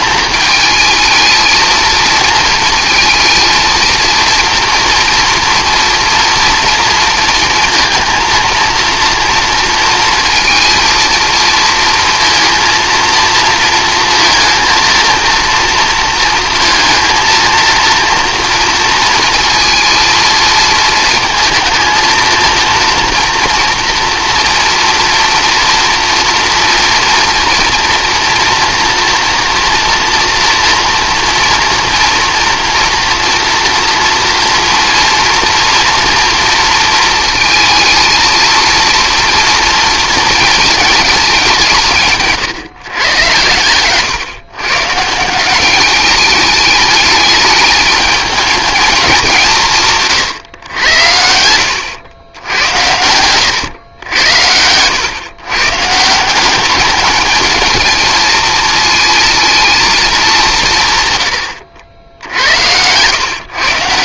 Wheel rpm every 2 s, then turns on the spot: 220, 230, 240, 230, 230, 230, 230, 230, 230, 230, 220, 230, 230, 240, 230, 230, 230, 230, 230, 230, 210, 130, 140, 210, 220, 100, 90, 100, 200, 220, 170, 100.
52-54